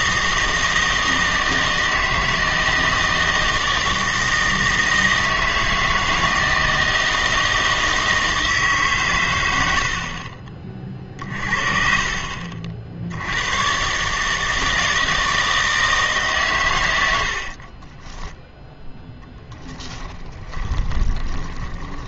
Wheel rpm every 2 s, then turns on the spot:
160, 160, 160, 160, 150, 40, 50, 160, 110, 10, 10.
20-22